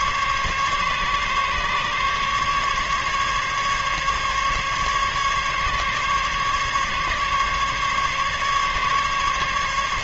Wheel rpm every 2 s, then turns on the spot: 140, 140, 140, 140, 140.
none